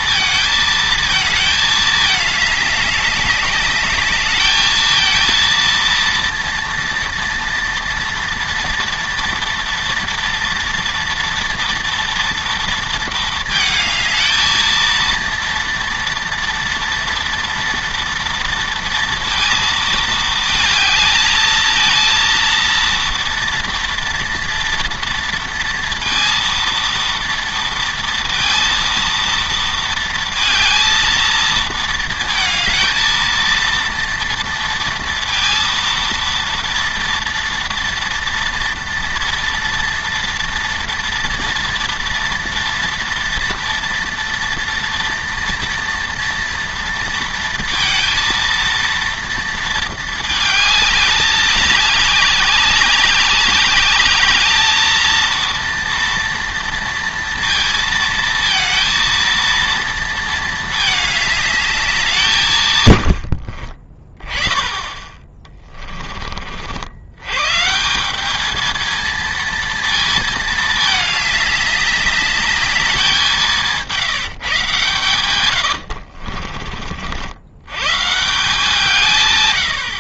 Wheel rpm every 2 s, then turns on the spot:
220, 210, 220, 230, 230, 230, 230, 230, 230, 230, 220, 230, 230, 230, 230, 220, 220, 230, 230, 230, 240, 230, 230, 230, 230, 220, 190, 220, 230, 220, 220, 150, 20, 60, 220, 220, 210, 140, 40, 160.
76-78